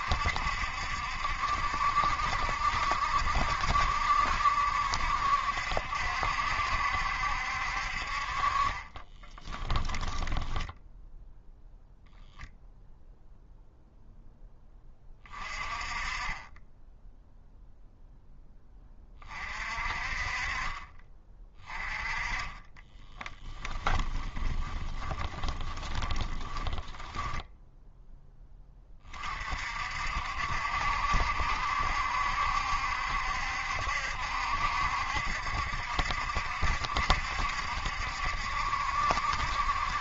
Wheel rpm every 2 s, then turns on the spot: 70, 70, 70, 70, 30, 10, 0, 20, 10, 20, 30, 10, 20, 10, 20, 70, 70, 70, 70, 70.
8-12 22-28